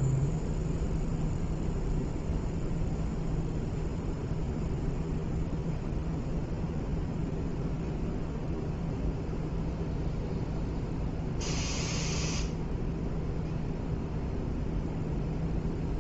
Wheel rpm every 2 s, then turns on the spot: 0, 0, 0, 0, 0, 0, 0, 0.
none